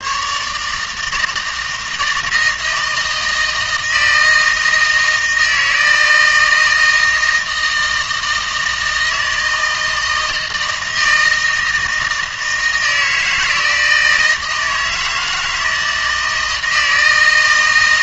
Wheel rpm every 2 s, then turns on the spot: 150, 160, 160, 160, 160, 160, 160, 160, 160.
none